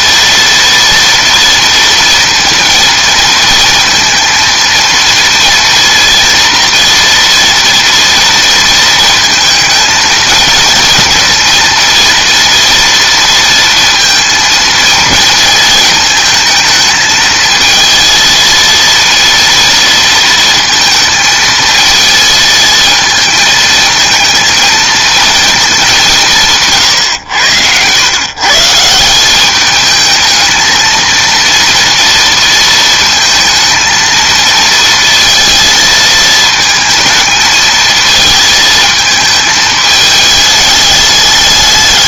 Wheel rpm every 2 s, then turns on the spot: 230, 230, 230, 230, 230, 230, 230, 230, 220, 230, 230, 220, 230, 150, 150, 220, 230, 230, 220, 220, 210.
none